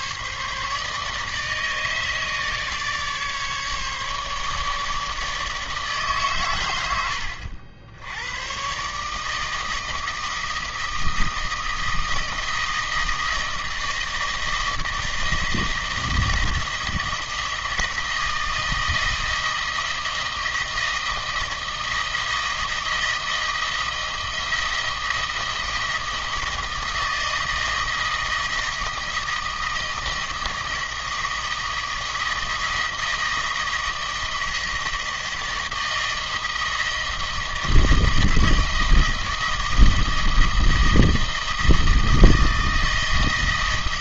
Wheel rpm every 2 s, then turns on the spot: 150, 150, 150, 110, 130, 160, 160, 160, 160, 160, 160, 160, 160, 160, 160, 160, 160, 160, 160, 160, 160, 160.
none